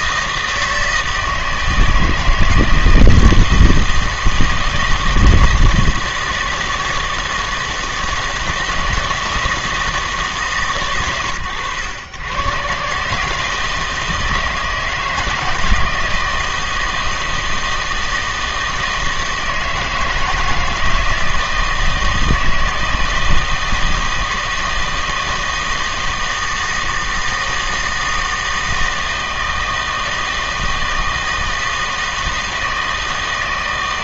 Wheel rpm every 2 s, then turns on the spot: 160, 160, 170, 160, 160, 130, 130, 160, 160, 160, 160, 160, 160, 160, 160, 160, 160.
none